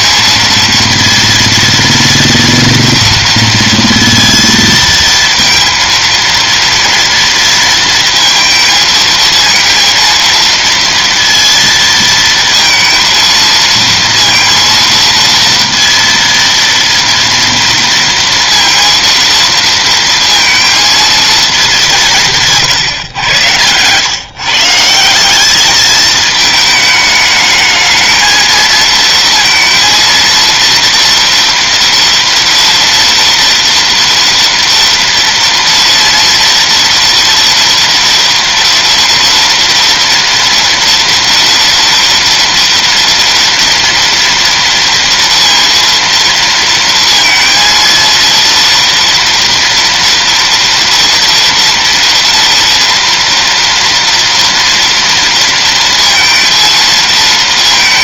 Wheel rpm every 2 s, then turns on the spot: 230, 230, 230, 230, 230, 230, 230, 230, 230, 230, 230, 140, 130, 220, 230, 230, 230, 230, 230, 230, 230, 230, 240, 230, 230, 240, 230, 230, 230.
22-24